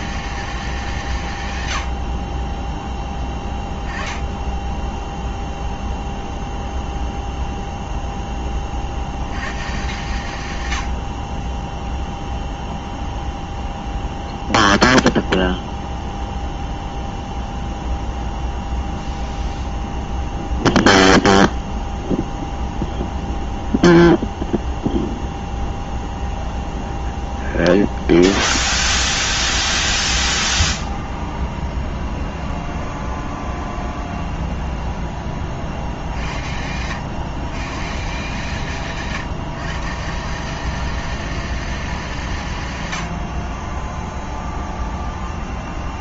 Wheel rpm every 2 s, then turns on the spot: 200, 20, 10, 0, 30, 100, 0, 0, 0, 0, 0, 0, 0, 0, 0, 0, 0, 0, 70, 150, 180, 140, 0.
2-4